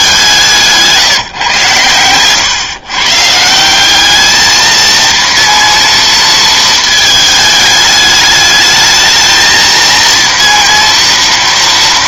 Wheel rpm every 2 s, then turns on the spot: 170, 120, 220, 220, 210, 230.
none